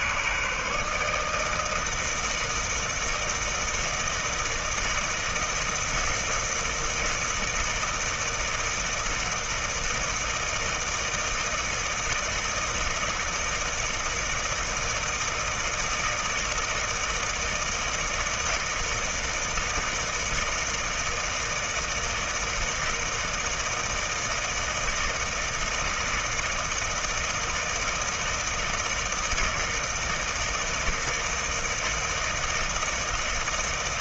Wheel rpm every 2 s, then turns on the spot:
150, 160, 160, 160, 160, 160, 160, 160, 160, 160, 160, 160, 160, 160, 160, 160, 160.
none